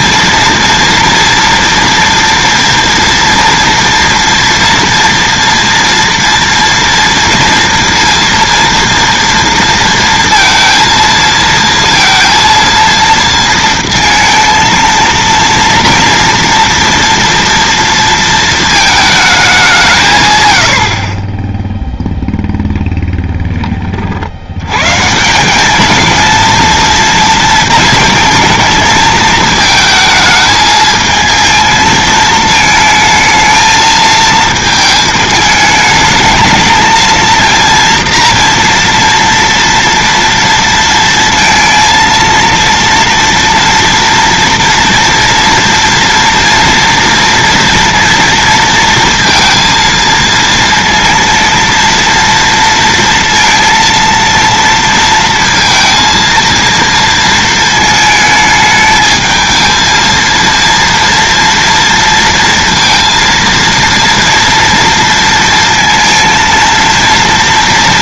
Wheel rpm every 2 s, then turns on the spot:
230, 230, 230, 230, 230, 230, 230, 230, 230, 220, 80, 10, 110, 230, 220, 220, 220, 220, 220, 230, 230, 230, 230, 230, 230, 230, 230, 230, 230, 220, 230, 230, 230, 230.
none